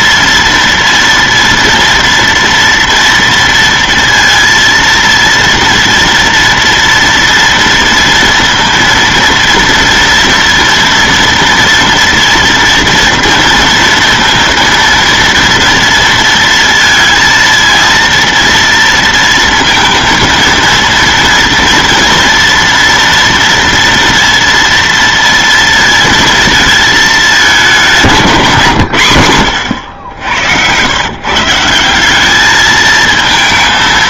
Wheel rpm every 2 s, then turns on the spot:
230, 230, 230, 230, 230, 230, 230, 230, 230, 230, 230, 230, 230, 230, 170, 100, 210.
none